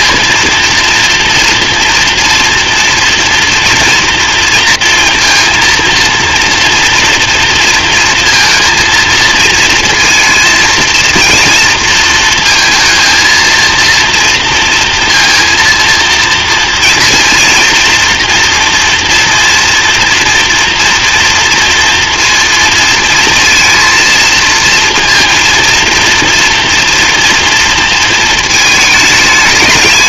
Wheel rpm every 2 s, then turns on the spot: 230, 230, 230, 230, 230, 230, 230, 230, 230, 230, 230, 230, 230, 230, 220.
none